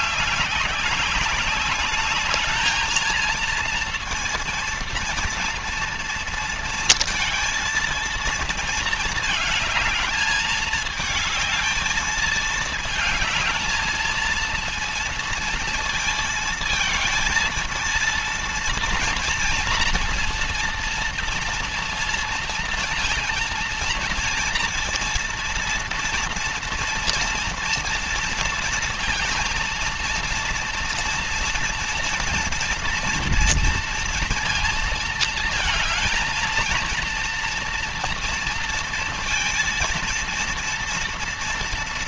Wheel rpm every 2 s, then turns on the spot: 200, 220, 230, 230, 220, 220, 220, 230, 230, 230, 230, 230, 230, 230, 230, 230, 230, 220, 230, 230, 230.
none